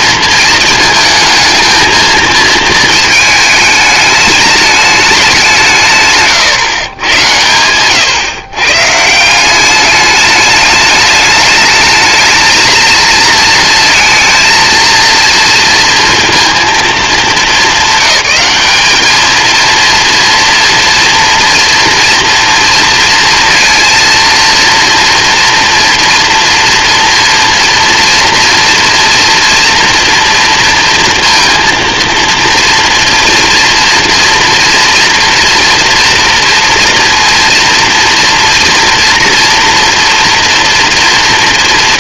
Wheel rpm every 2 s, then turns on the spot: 220, 220, 190, 120, 160, 210, 230, 230, 210, 210, 230, 230, 230, 230, 230, 230, 240, 230, 230, 230, 230.
none